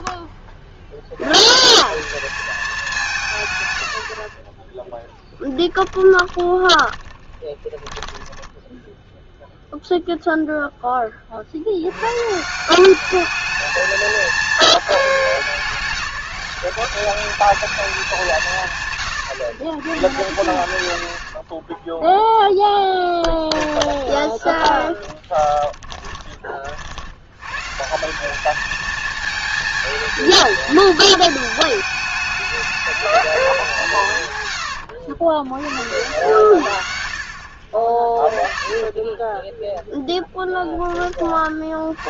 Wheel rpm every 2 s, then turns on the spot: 20, 220, 30, 20, 10, 0, 160, 220, 200, 170, 100, 10, 40, 40, 210, 220, 210, 110, 80, 30, 0.
6-10 22-26 34-36 38-40